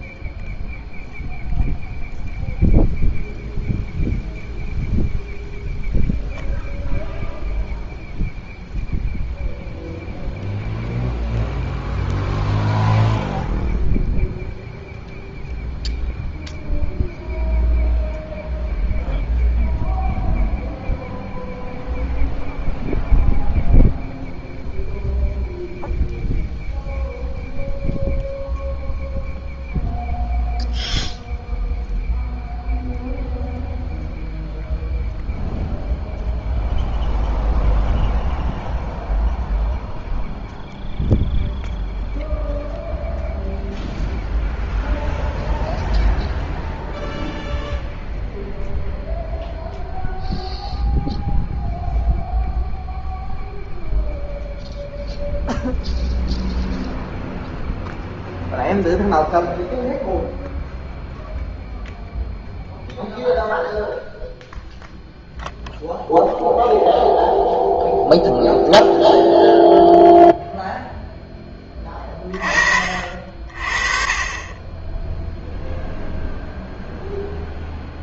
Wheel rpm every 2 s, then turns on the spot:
0, 0, 0, 0, 0, 0, 0, 0, 0, 0, 0, 0, 0, 0, 0, 0, 0, 0, 0, 0, 0, 0, 0, 0, 0, 0, 0, 0, 0, 0, 0, 0, 0, 0, 0, 0, 40, 20, 0.
none